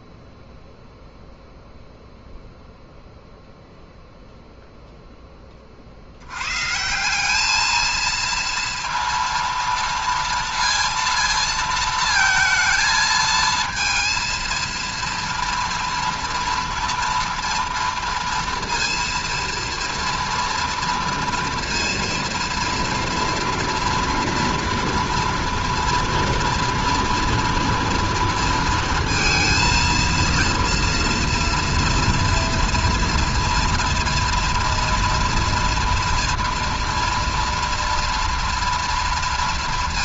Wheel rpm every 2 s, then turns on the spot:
0, 0, 0, 120, 230, 230, 230, 230, 230, 230, 230, 230, 230, 230, 230, 230, 230, 230, 230, 230.
none